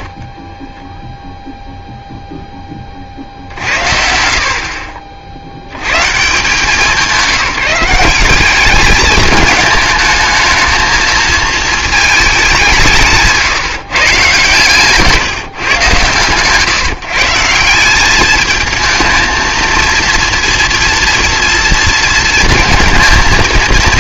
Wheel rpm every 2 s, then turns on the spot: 10, 20, 50, 170, 200, 220, 190, 140, 130, 220, 230, 230.
0-2 14-16